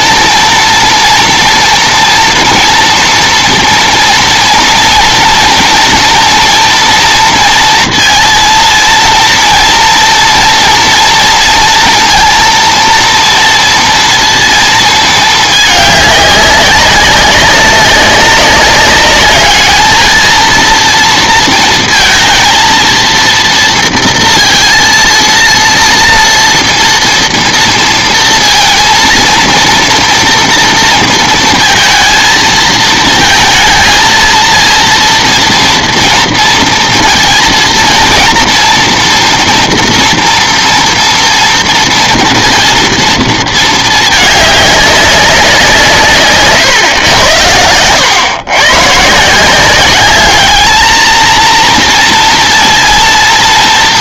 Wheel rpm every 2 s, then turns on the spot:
230, 240, 230, 230, 230, 230, 230, 230, 200, 200, 230, 230, 230, 230, 230, 230, 220, 230, 230, 230, 230, 230, 200, 130, 110, 210, 230.
46-48